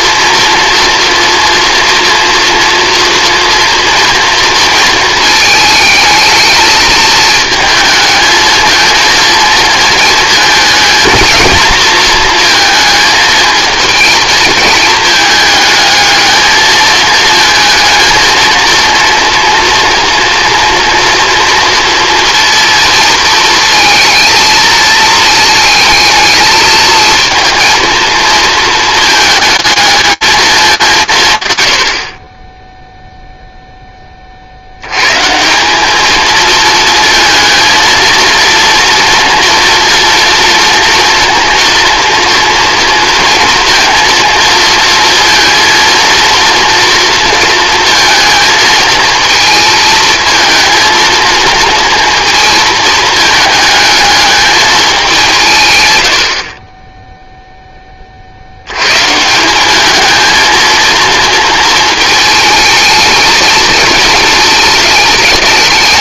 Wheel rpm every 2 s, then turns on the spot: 230, 230, 230, 220, 220, 230, 220, 220, 220, 230, 230, 230, 220, 220, 220, 190, 10, 80, 230, 230, 230, 230, 230, 230, 230, 220, 220, 210, 40, 110, 230, 220, 220.
none